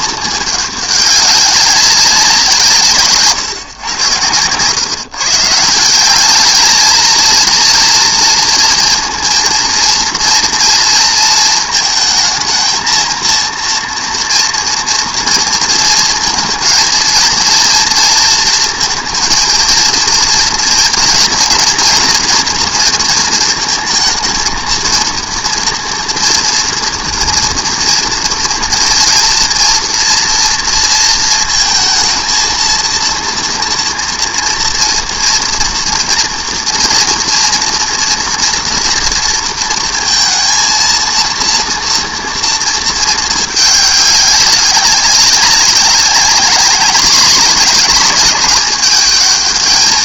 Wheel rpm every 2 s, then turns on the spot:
210, 170, 130, 220, 230, 230, 230, 230, 220, 230, 230, 230, 220, 230, 230, 230, 230, 230, 230, 230, 230, 230, 200, 210, 210.
none